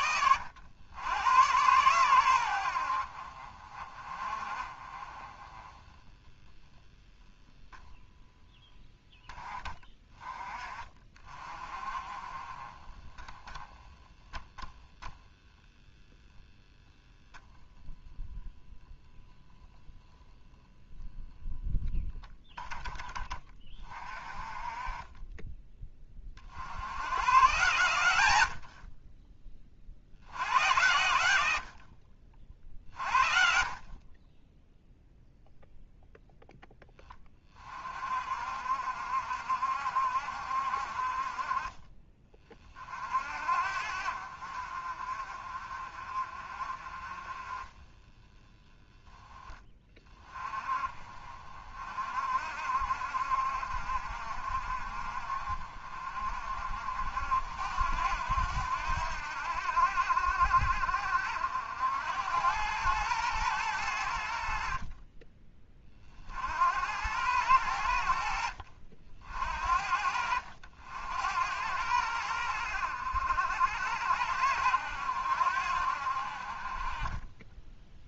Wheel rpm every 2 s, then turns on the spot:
100, 80, 30, 10, 10, 30, 20, 0, 0, 0, 0, 10, 30, 80, 70, 100, 50, 0, 10, 60, 60, 40, 50, 30, 10, 30, 60, 50, 60, 80, 70, 100, 50, 70, 60, 70, 80, 80, 40.
none